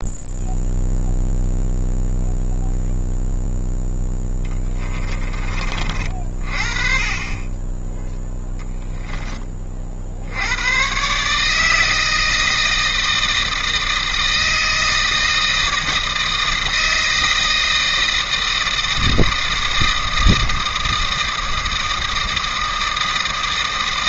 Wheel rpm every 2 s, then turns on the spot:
0, 0, 10, 30, 10, 110, 160, 160, 160, 160, 160, 160.
4-6 8-10